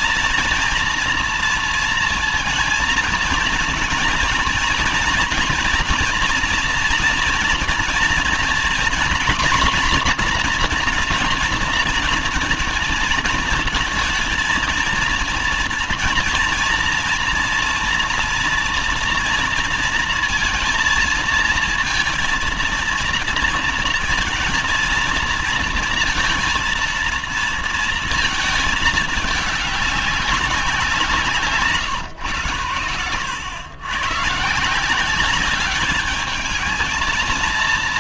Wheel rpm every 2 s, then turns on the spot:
230, 230, 230, 230, 230, 240, 220, 230, 240, 230, 230, 230, 230, 230, 220, 200, 120, 160, 220.
none